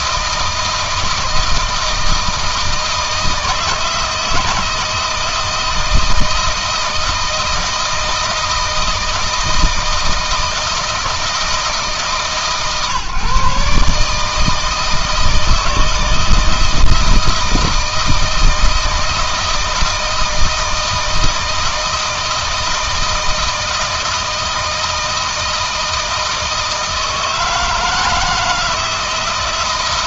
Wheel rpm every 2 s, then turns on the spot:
160, 160, 160, 160, 160, 160, 130, 160, 160, 160, 160, 160, 160, 160, 160.
none